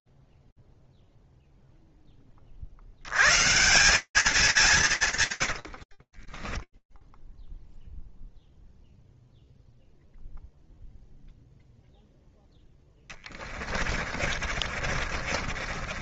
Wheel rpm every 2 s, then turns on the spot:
0, 10, 150, 20, 0, 0, 20, 50.
6-8 12-16